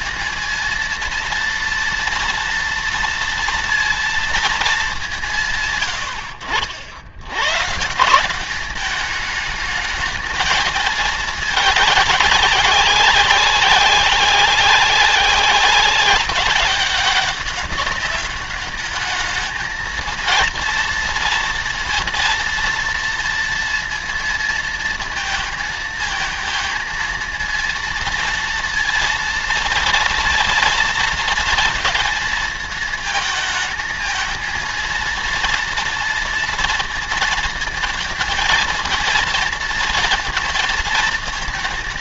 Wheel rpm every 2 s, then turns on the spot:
230, 230, 190, 80, 210, 220, 200, 190, 190, 210, 230, 230, 230, 230, 230, 230, 220, 230, 230, 230, 230.
none